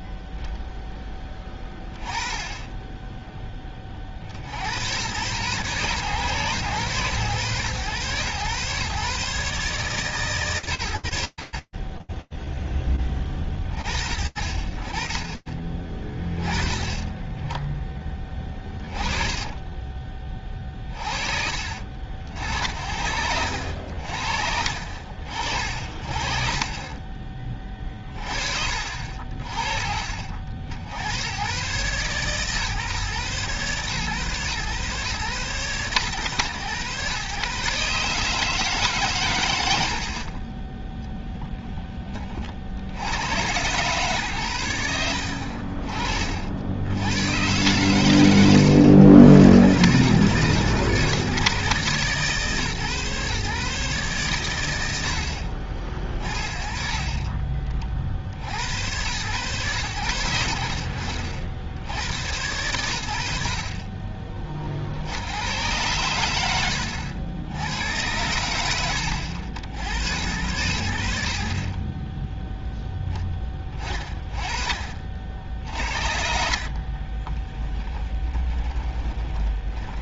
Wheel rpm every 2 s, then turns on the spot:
0, 20, 80, 110, 120, 140, 20, 40, 30, 20, 30, 70, 60, 40, 50, 110, 130, 120, 130, 100, 20, 130, 40, 130, 120, 140, 140, 40, 50, 100, 70, 50, 90, 90, 80, 40, 10, 70, 20, 20.
18-22 76-80